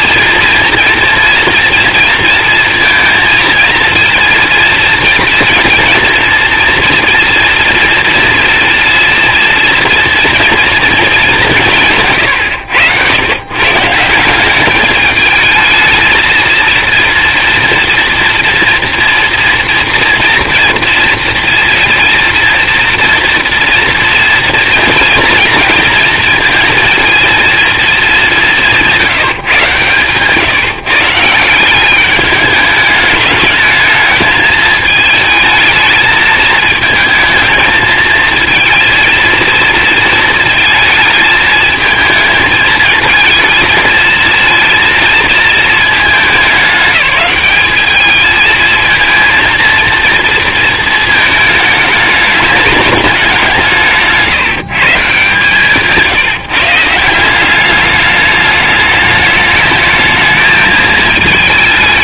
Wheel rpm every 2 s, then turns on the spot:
230, 230, 240, 230, 230, 160, 150, 220, 230, 230, 230, 230, 230, 220, 140, 180, 210, 220, 220, 230, 220, 220, 220, 210, 230, 220, 180, 150, 200, 220, 220.
none